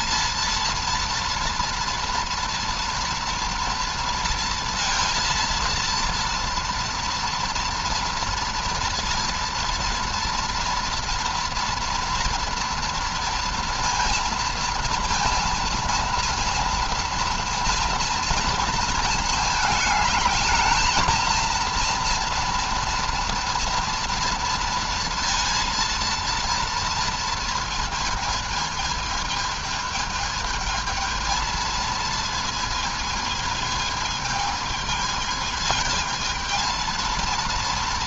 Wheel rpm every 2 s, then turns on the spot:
230, 230, 230, 230, 230, 230, 230, 230, 230, 230, 220, 230, 230, 230, 220, 220, 220, 220, 220.
none